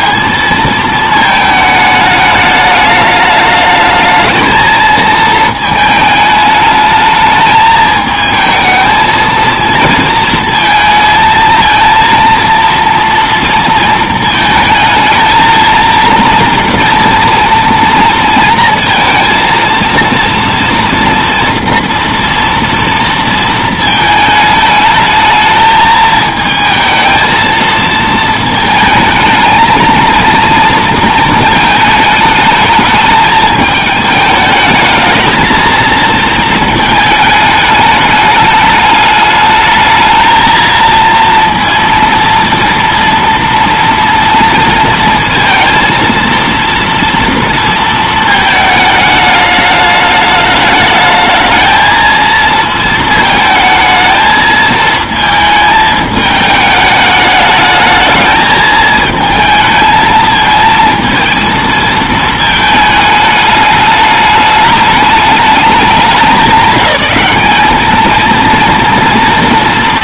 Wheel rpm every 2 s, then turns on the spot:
220, 210, 220, 220, 220, 220, 230, 220, 230, 230, 230, 230, 220, 220, 220, 220, 210, 220, 210, 210, 230, 230, 230, 230, 210, 220, 220, 220, 210, 220, 230, 210, 200, 200, 220.
none